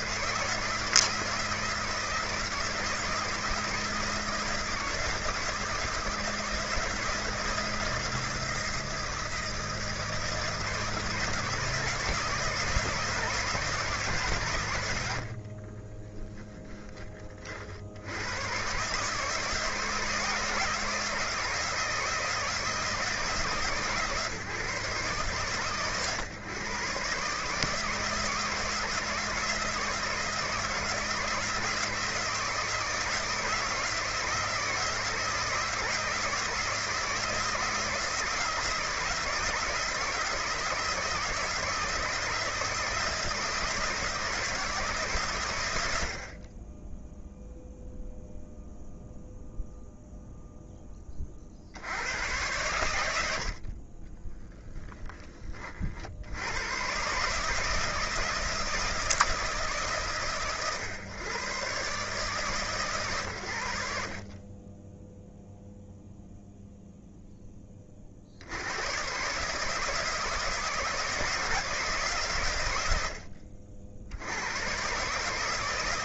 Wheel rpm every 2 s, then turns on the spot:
160, 160, 160, 160, 160, 160, 160, 110, 20, 130, 160, 160, 130, 130, 160, 160, 160, 160, 160, 160, 160, 160, 150, 20, 0, 10, 90, 10, 120, 160, 120, 130, 20, 0, 110, 160, 80, 130.
none